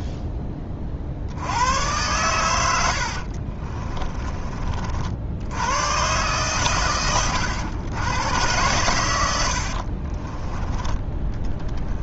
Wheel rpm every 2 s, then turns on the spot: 30, 90, 40, 120, 110, 10.
none